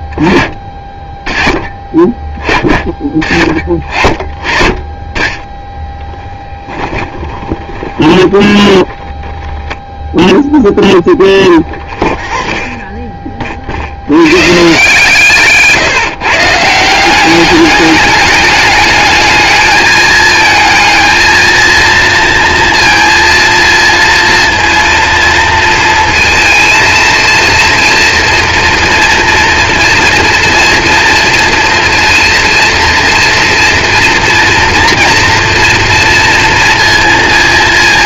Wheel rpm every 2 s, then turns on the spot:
10, 10, 30, 10, 20, 0, 0, 130, 160, 210, 220, 230, 230, 230, 240, 240, 230, 240, 230.
6-8